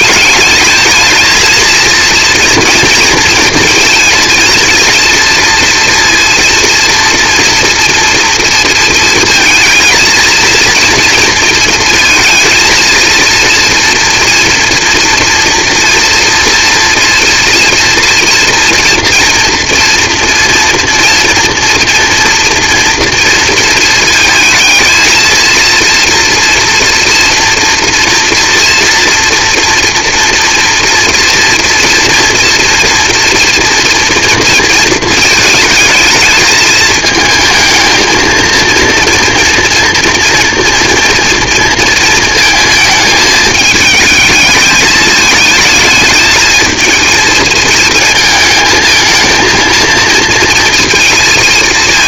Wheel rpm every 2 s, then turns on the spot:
210, 230, 220, 230, 230, 230, 230, 230, 230, 230, 230, 240, 230, 240, 230, 230, 230, 230, 220, 230, 240, 220, 210, 220, 220, 230.
none